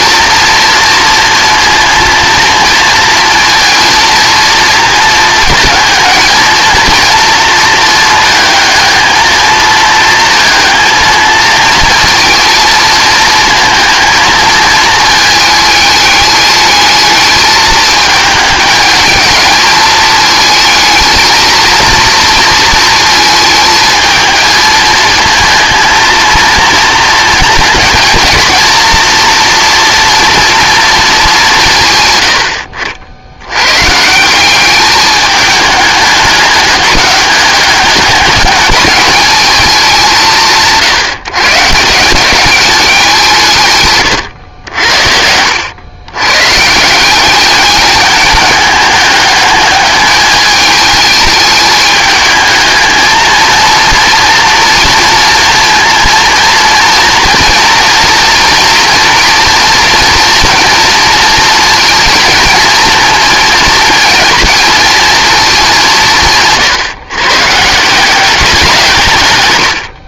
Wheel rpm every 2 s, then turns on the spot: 230, 230, 230, 230, 220, 220, 220, 220, 210, 220, 220, 230, 220, 220, 230, 230, 70, 210, 200, 220, 160, 190, 70, 170, 210, 220, 220, 230, 230, 240, 230, 230, 230, 140, 160.
44-46